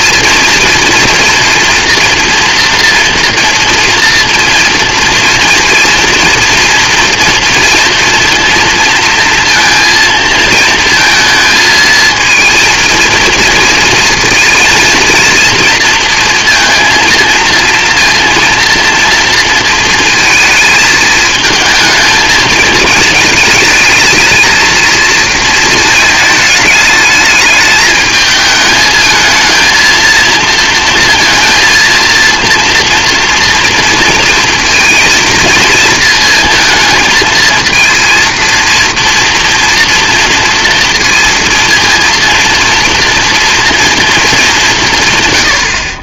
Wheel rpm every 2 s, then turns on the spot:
230, 230, 230, 230, 230, 230, 230, 230, 230, 230, 220, 220, 230, 220, 220, 230, 230, 230, 220, 230, 230, 230, 190.
none